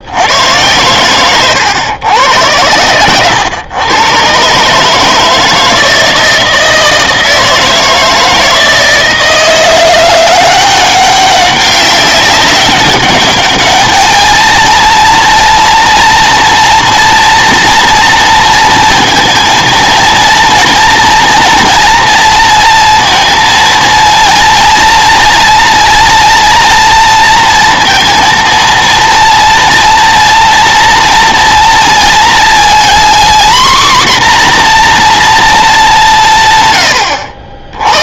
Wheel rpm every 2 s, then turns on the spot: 100, 100, 150, 160, 160, 190, 200, 230, 230, 230, 230, 230, 230, 230, 230, 230, 240, 250, 120.
none